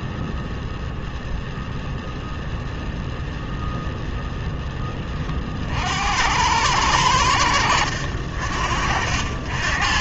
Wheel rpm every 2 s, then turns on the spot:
0, 0, 10, 90, 50.
none